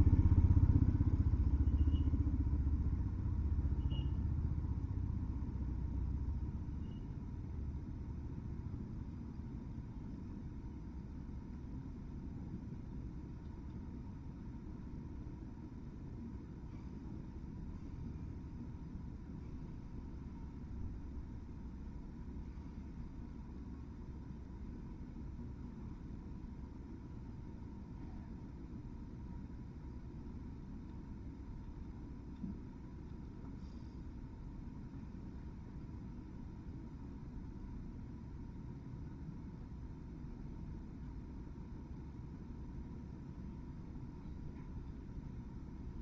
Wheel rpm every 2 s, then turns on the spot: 0, 0, 0, 0, 0, 0, 0, 0, 0, 0, 0, 0, 0, 0, 0, 0, 0, 0, 0, 0, 0, 0, 0.
none